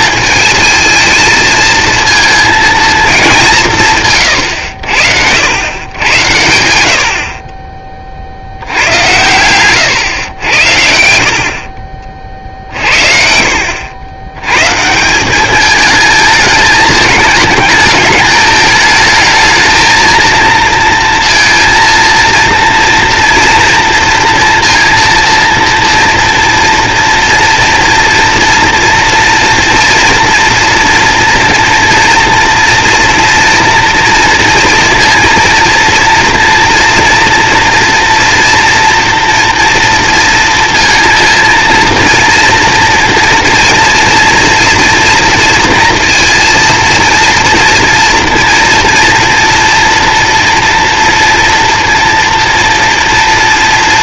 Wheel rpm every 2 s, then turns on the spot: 220, 220, 100, 80, 90, 90, 50, 130, 220, 210, 230, 230, 230, 230, 230, 230, 230, 230, 230, 230, 230, 230, 230, 230, 230, 230, 230.
none